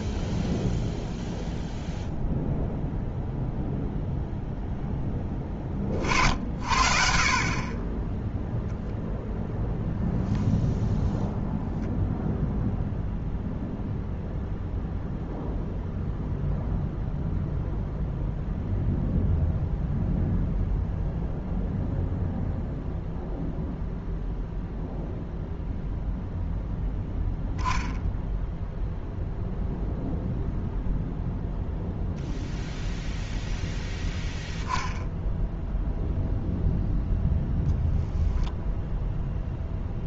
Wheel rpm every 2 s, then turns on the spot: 0, 0, 10, 50, 0, 0, 0, 0, 0, 0, 0, 0, 0, 0, 0, 0, 0, 10, 10, 10.
none